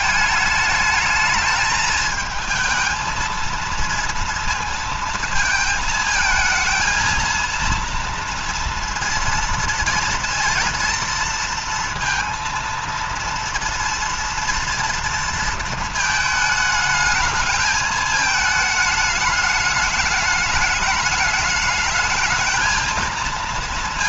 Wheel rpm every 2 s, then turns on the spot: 220, 220, 230, 220, 230, 230, 230, 230, 220, 220, 210, 220.
none